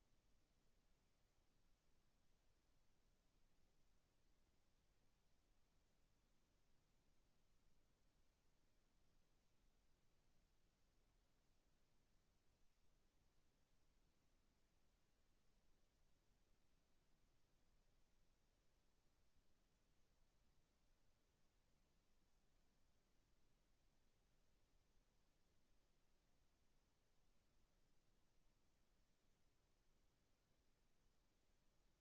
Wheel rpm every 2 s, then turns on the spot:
0, 0, 0, 0, 0, 0, 0, 0, 0, 0, 0, 0, 0, 0, 0, 0.
none